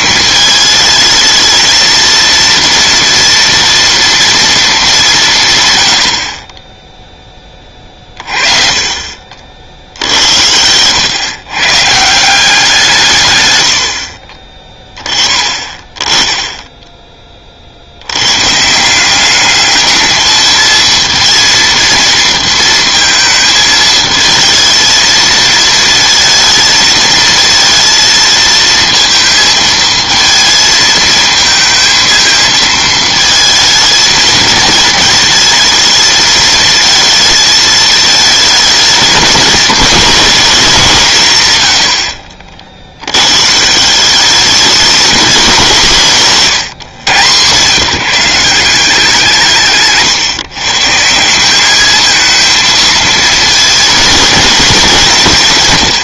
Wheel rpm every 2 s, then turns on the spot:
220, 230, 210, 20, 40, 110, 170, 30, 10, 160, 220, 230, 220, 220, 230, 220, 220, 220, 220, 210, 180, 60, 200, 130, 170, 140, 230, 190.
none